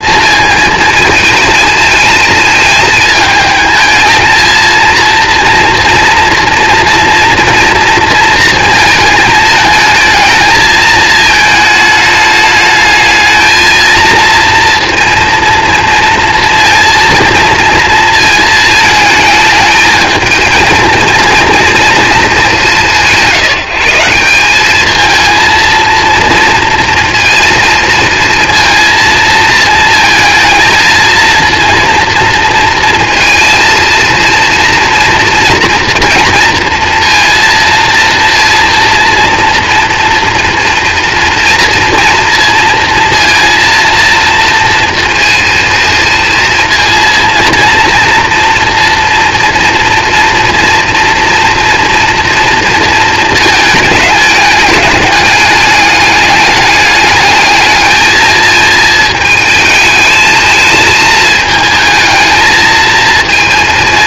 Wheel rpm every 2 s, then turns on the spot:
220, 220, 220, 230, 220, 220, 210, 230, 230, 220, 230, 180, 200, 230, 230, 220, 230, 230, 230, 230, 230, 230, 230, 230, 230, 240, 230, 210, 200, 220, 220, 220.
none